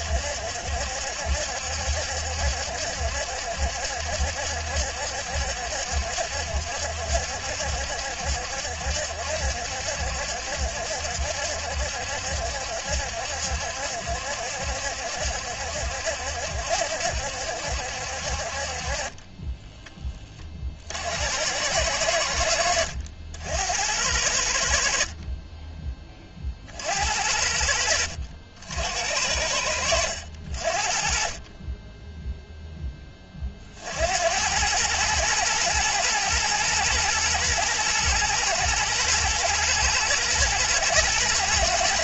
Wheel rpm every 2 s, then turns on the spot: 70, 70, 70, 70, 70, 70, 70, 70, 70, 40, 50, 70, 60, 40, 70, 40, 10, 110, 120, 110, 120.
22-24